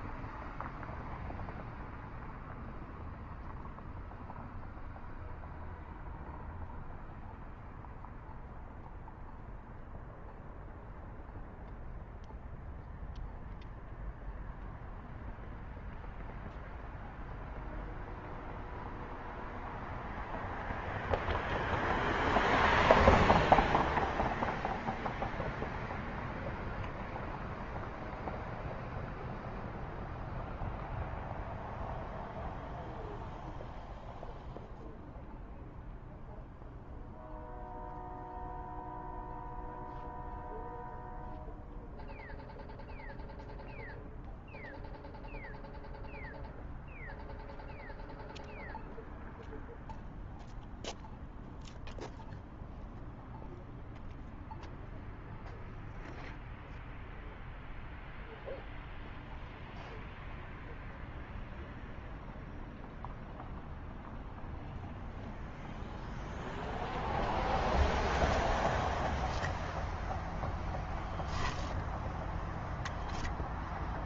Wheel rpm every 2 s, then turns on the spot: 0, 0, 0, 0, 0, 0, 0, 0, 0, 0, 0, 0, 0, 0, 0, 0, 0, 0, 0, 0, 0, 0, 0, 0, 0, 0, 0, 0, 0, 0, 0, 0, 0, 0, 0, 0, 0.
none